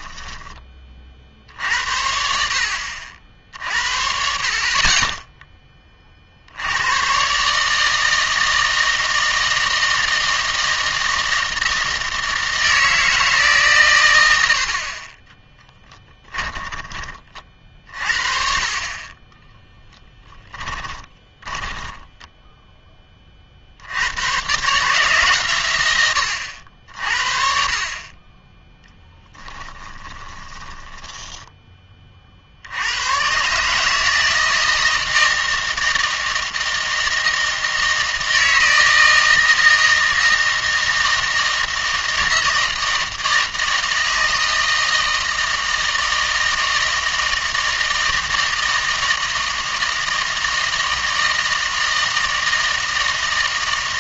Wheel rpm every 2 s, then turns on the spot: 20, 70, 40, 80, 160, 160, 160, 60, 20, 40, 20, 10, 140, 80, 10, 10, 60, 160, 160, 160, 160, 160, 160, 160, 160, 160, 160.
16-18 20-24 30-32